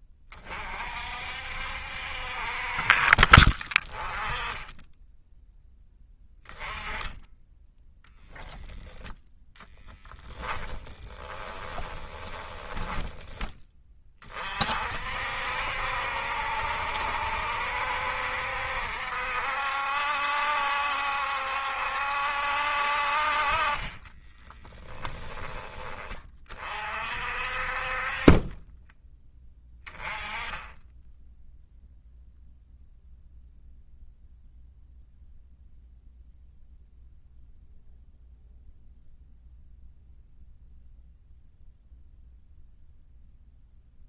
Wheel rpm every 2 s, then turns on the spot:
40, 40, 10, 10, 0, 10, 20, 50, 70, 70, 70, 50, 10, 40, 20, 10, 0, 0, 0, 0, 0, 0.
10-14 24-26